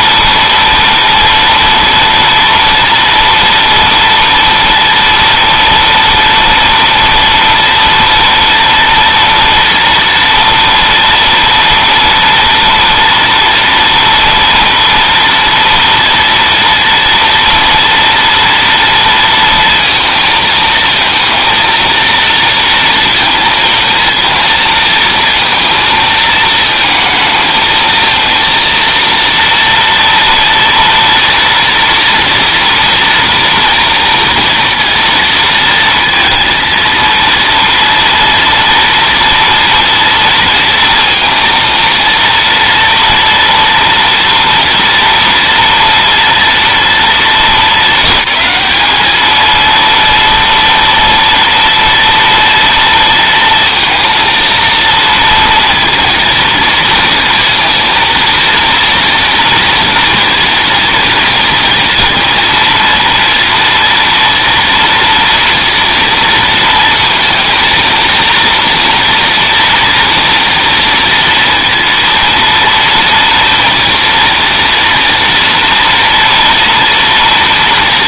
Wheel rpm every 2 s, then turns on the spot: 230, 230, 230, 230, 230, 230, 230, 230, 230, 230, 230, 230, 230, 230, 230, 230, 230, 230, 230, 230, 230, 230, 230, 230, 200, 230, 230, 230, 230, 230, 230, 230, 240, 230, 230, 230, 230, 230, 230.
none